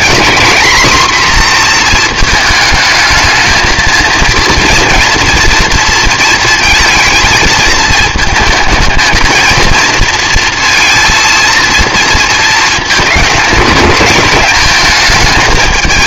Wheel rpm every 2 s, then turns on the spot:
250, 220, 230, 230, 220, 230, 220, 210.
none